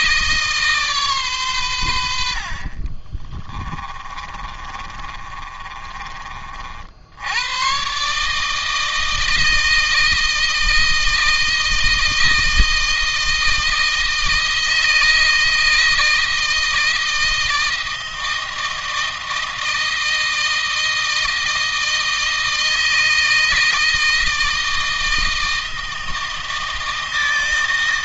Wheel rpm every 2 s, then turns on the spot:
150, 40, 30, 60, 160, 160, 160, 160, 160, 160, 160, 160, 160, 160.
2-6